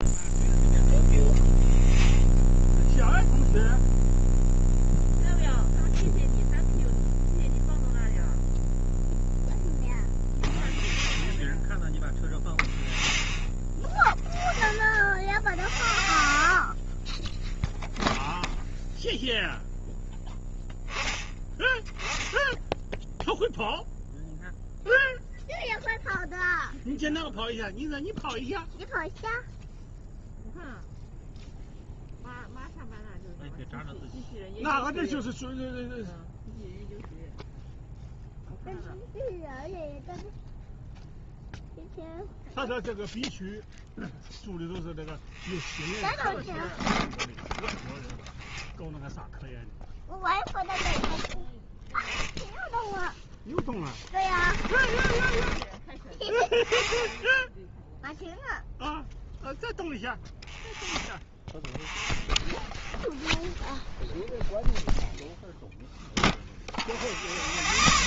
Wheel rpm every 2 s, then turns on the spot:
0, 0, 0, 0, 0, 0, 0, 0, 0, 0, 0, 10, 0, 0, 0, 0, 0, 0, 0, 0, 0, 0, 0, 0, 0, 10, 10, 20, 10, 0, 0, 0, 0, 0.
54-56